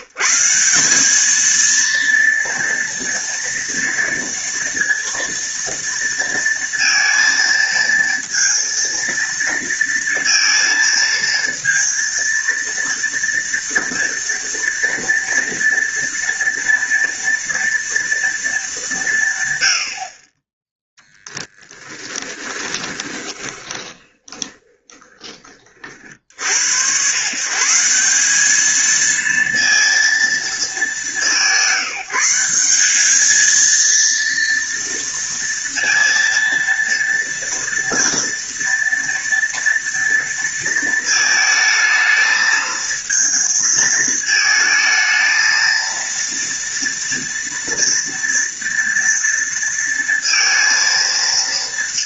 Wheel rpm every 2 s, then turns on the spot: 190, 230, 230, 230, 230, 230, 230, 230, 230, 200, 10, 20, 20, 90, 220, 210, 190, 230, 230, 230, 230, 220, 220, 230, 240, 230.
20-26